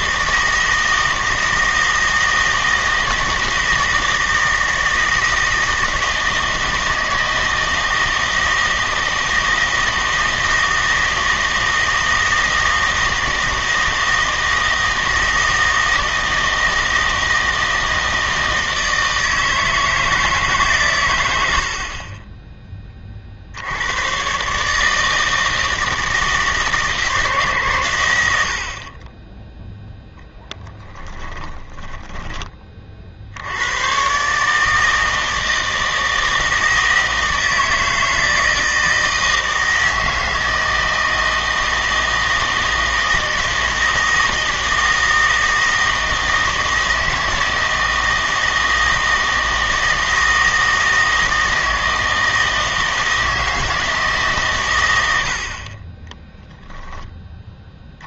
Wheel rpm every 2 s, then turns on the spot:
160, 160, 160, 160, 160, 160, 160, 160, 160, 160, 140, 20, 150, 160, 60, 10, 30, 150, 160, 160, 160, 160, 160, 160, 160, 160, 160, 120, 20.
30-32 56-58